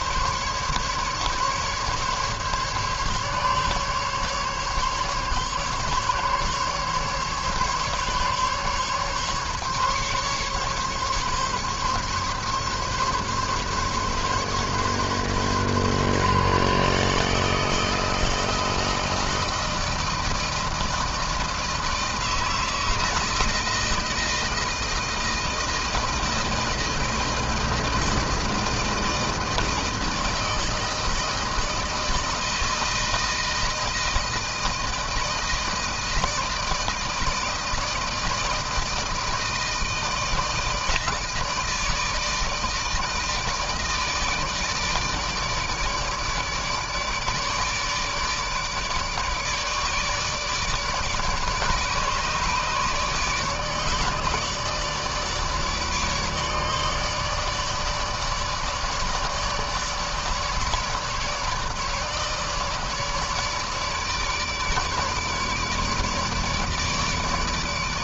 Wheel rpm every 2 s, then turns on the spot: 150, 140, 140, 140, 140, 140, 140, 140, 140, 160, 160, 160, 160, 160, 160, 160, 160, 160, 160, 160, 160, 160, 160, 150, 160, 150, 150, 150, 150, 150, 150, 150, 150, 150.
none